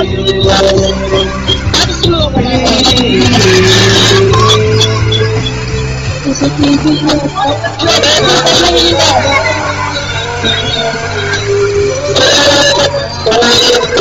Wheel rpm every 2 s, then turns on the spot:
30, 30, 150, 160, 160, 160, 160.
none